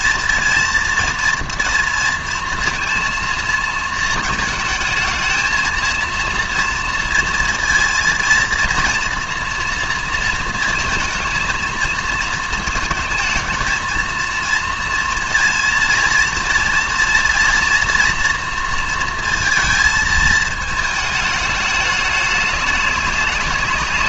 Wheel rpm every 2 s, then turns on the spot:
230, 230, 220, 230, 230, 230, 230, 230, 230, 230, 220, 200.
none